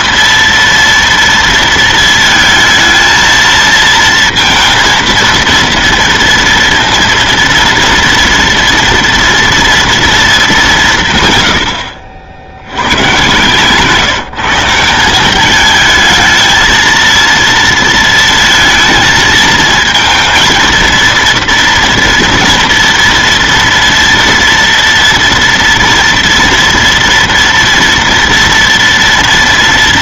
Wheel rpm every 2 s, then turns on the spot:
230, 220, 230, 230, 230, 180, 100, 180, 230, 220, 230, 230, 230, 230, 230.
none